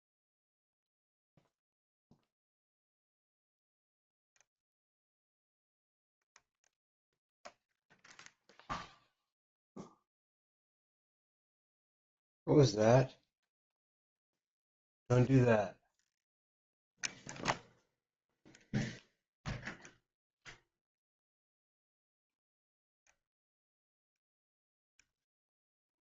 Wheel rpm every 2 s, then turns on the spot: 0, 0, 0, 0, 0, 0, 0, 0, 0, 0, 0, 0, 0.
none